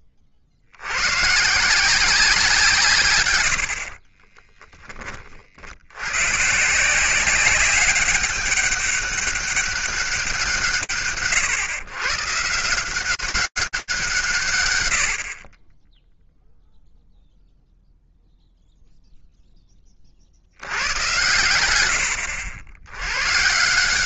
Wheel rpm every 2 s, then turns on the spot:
60, 160, 20, 170, 200, 120, 170, 110, 0, 0, 100, 110.
none